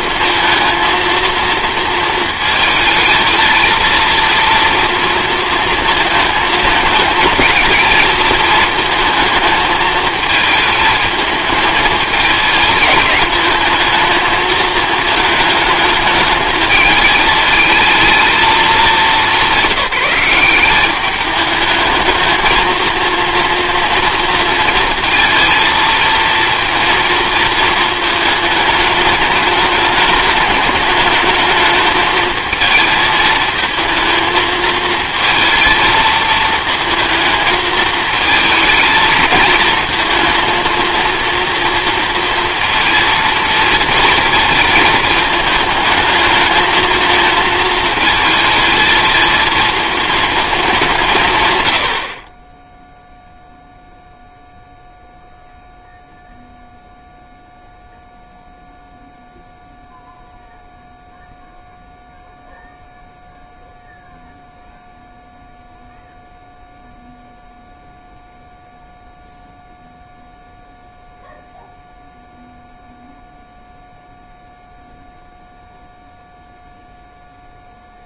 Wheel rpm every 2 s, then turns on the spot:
230, 220, 230, 220, 220, 220, 210, 220, 210, 210, 190, 220, 230, 230, 210, 210, 230, 220, 230, 220, 230, 230, 220, 220, 220, 200, 10, 0, 0, 0, 0, 0, 0, 0, 0, 0, 0, 0, 0.
none